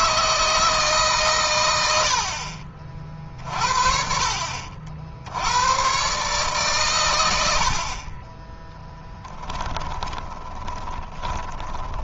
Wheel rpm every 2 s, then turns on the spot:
160, 60, 60, 130, 20, 20.
10-12